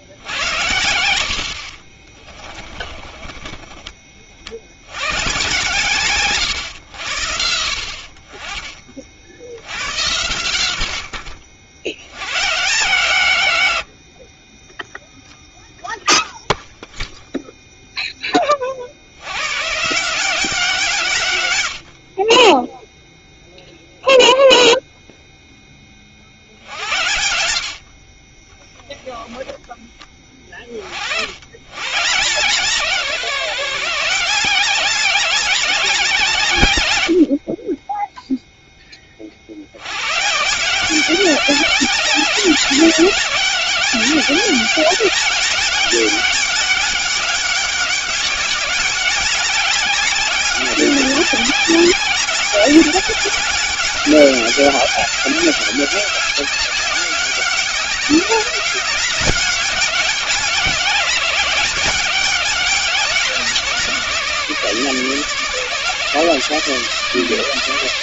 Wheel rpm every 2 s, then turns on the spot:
70, 30, 100, 90, 40, 80, 140, 0, 0, 60, 160, 0, 0, 70, 0, 50, 150, 180, 100, 20, 180, 200, 200, 200, 190, 200, 200, 200, 200, 200, 190, 190, 150, 150.
2-4